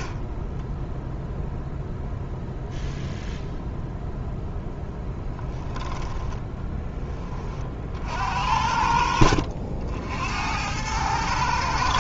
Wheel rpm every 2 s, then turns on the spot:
20, 0, 0, 10, 70, 90.
none